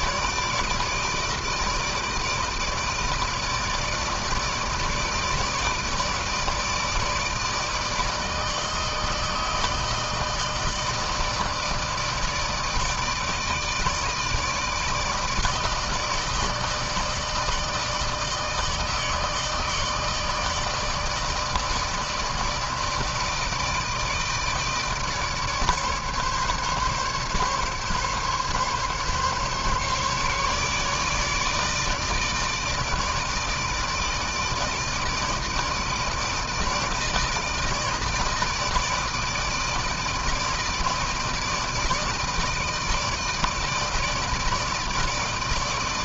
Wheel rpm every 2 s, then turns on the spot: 150, 160, 150, 160, 160, 160, 160, 150, 160, 160, 160, 160, 160, 150, 140, 150, 160, 160, 160, 160, 160, 160, 160.
none